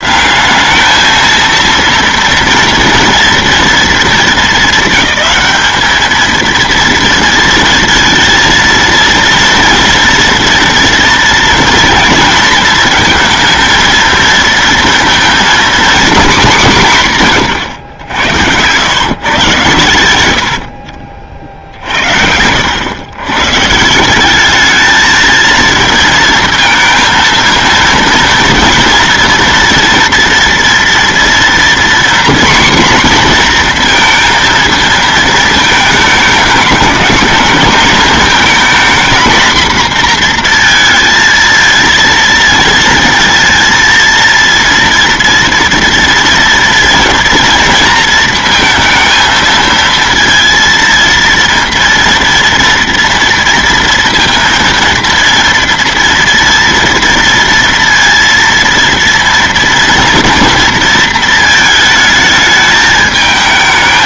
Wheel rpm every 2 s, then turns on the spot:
220, 230, 210, 230, 230, 230, 230, 230, 170, 120, 70, 100, 220, 220, 230, 230, 240, 230, 210, 230, 230, 230, 230, 230, 230, 230, 230, 230, 230, 230, 230, 220.
20-22